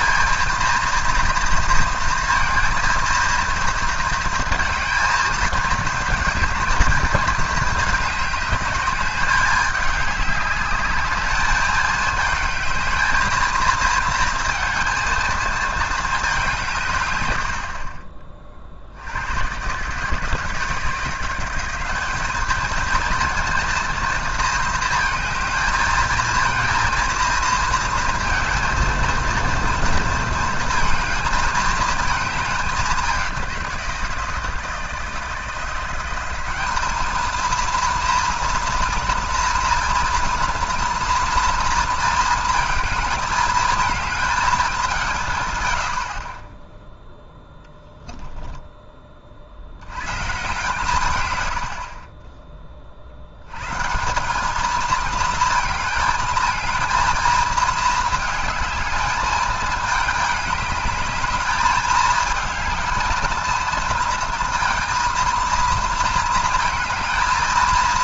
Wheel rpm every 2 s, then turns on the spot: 240, 230, 230, 220, 210, 210, 220, 220, 170, 60, 160, 230, 220, 230, 230, 220, 200, 160, 200, 230, 230, 220, 200, 10, 10, 130, 30, 210, 220, 210, 210, 220, 230, 230.
none